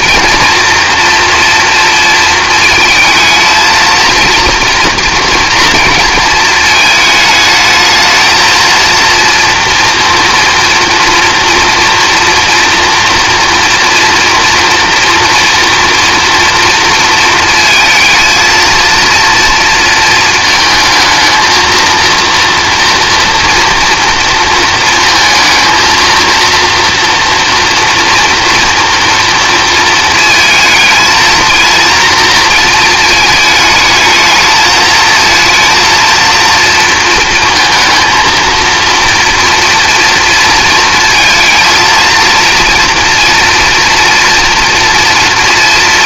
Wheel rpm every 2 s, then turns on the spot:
230, 220, 230, 220, 230, 230, 230, 230, 230, 230, 230, 240, 230, 230, 240, 220, 230, 220, 230, 230, 230, 230, 240.
none